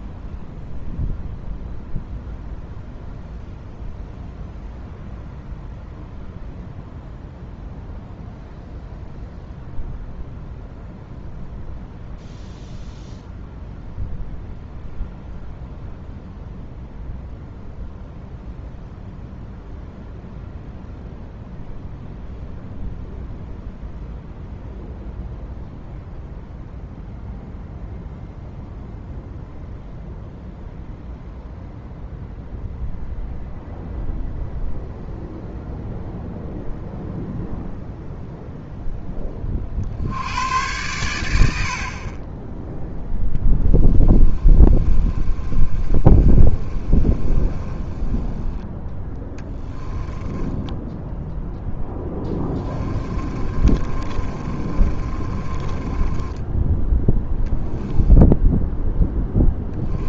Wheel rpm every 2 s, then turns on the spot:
0, 0, 0, 0, 0, 0, 0, 0, 0, 0, 0, 0, 0, 0, 0, 0, 0, 0, 0, 10, 90, 0, 20, 20, 10, 0, 30, 30, 0, 10.
44-48 52-56